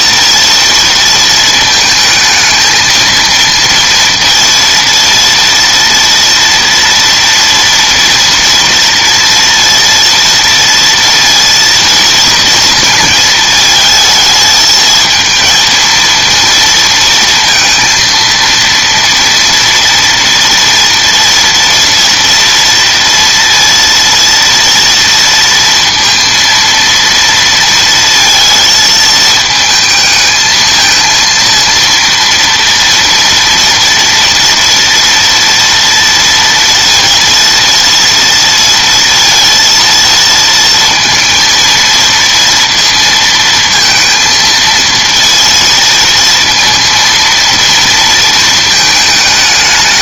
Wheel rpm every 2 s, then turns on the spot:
230, 230, 230, 230, 230, 230, 230, 220, 230, 230, 230, 230, 230, 230, 220, 220, 230, 230, 230, 230, 230, 230, 230, 230, 220.
none